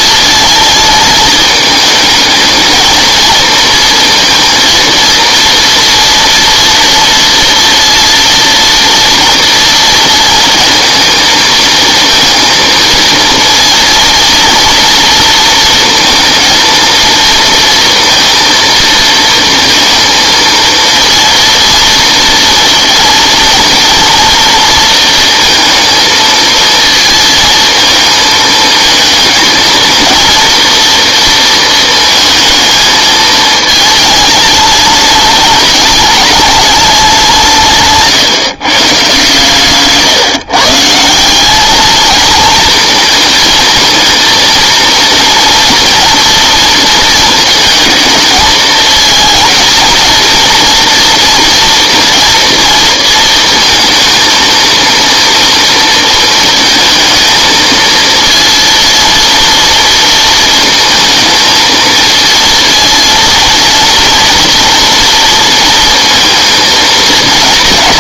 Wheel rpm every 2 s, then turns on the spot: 230, 230, 230, 230, 230, 220, 230, 230, 230, 230, 230, 230, 230, 220, 220, 230, 230, 220, 210, 140, 150, 220, 230, 230, 220, 240, 230, 230, 220, 230, 230, 230, 240, 230.
none